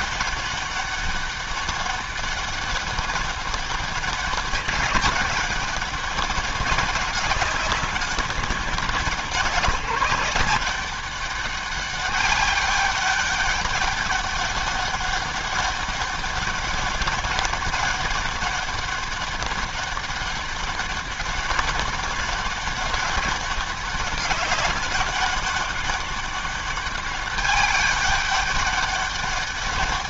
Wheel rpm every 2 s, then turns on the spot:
200, 200, 190, 200, 180, 190, 200, 200, 200, 200, 200, 200, 200, 200, 200.
none